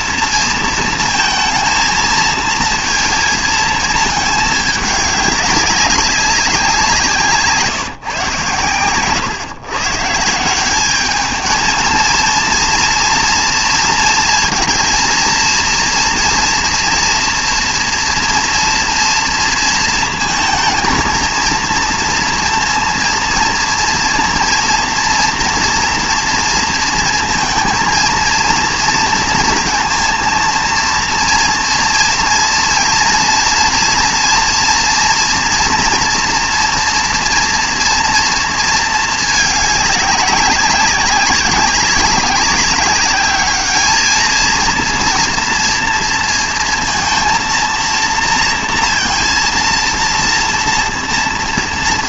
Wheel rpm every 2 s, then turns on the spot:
230, 230, 210, 180, 130, 190, 230, 230, 230, 230, 230, 230, 230, 230, 230, 230, 240, 230, 230, 230, 200, 200, 230, 230, 230, 230.
8-10